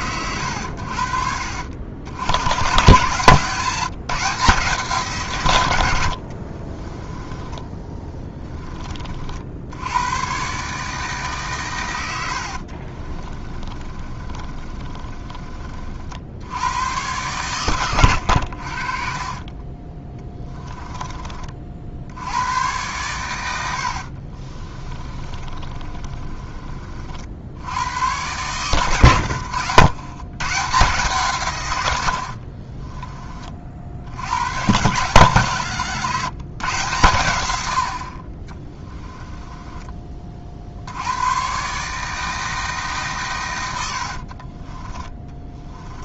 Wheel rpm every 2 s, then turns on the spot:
80, 120, 160, 40, 20, 150, 40, 30, 100, 60, 10, 110, 30, 40, 110, 150, 30, 110, 130, 20, 60, 150, 30.
6-8 12-16 24-26 32-34 38-40 44-46